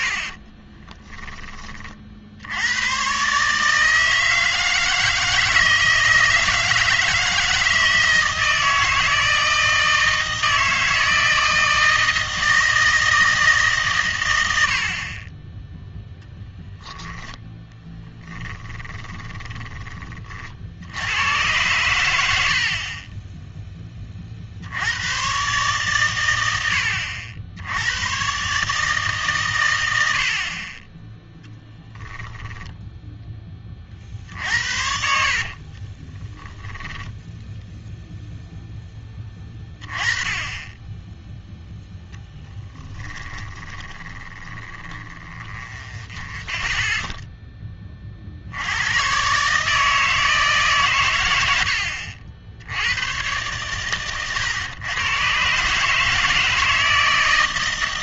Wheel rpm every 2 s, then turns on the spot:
20, 90, 160, 160, 160, 160, 160, 80, 10, 20, 60, 60, 70, 90, 150, 30, 0, 70, 10, 10, 10, 20, 20, 10, 80, 140, 90, 110, 160.
0-2 18-20 34-38 42-48